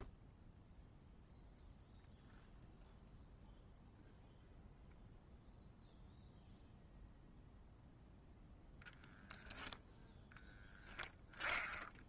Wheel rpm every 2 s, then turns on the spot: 0, 0, 0, 0, 0, 10.
none